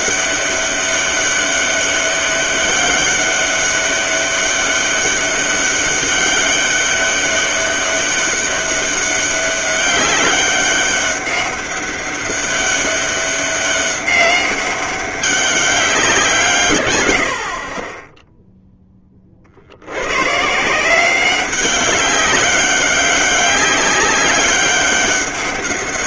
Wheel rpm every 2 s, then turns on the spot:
200, 200, 200, 200, 200, 200, 190, 200, 130, 10, 170, 190, 200.
none